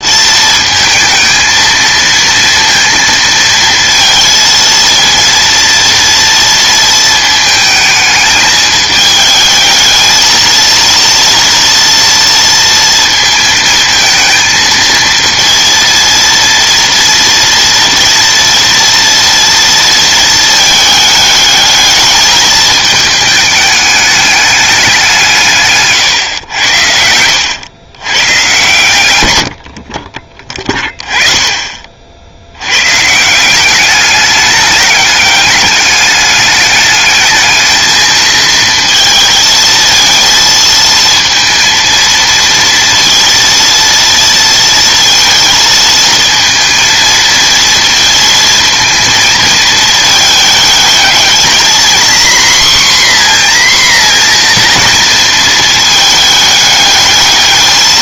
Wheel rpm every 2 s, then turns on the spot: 220, 230, 230, 220, 210, 230, 230, 230, 230, 230, 220, 220, 200, 90, 110, 20, 120, 210, 210, 220, 230, 230, 230, 230, 230, 220, 250, 230, 210.
none